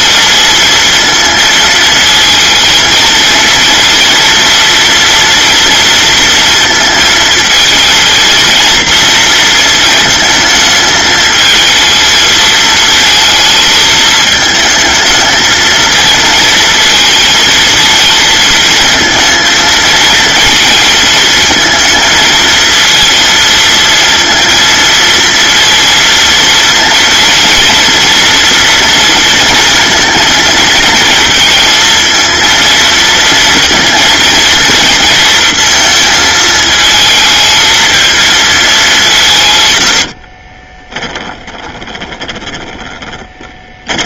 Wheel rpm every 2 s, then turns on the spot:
230, 230, 230, 230, 230, 220, 220, 220, 220, 230, 220, 230, 230, 230, 240, 220, 230, 220, 220, 210, 20, 30.
40-44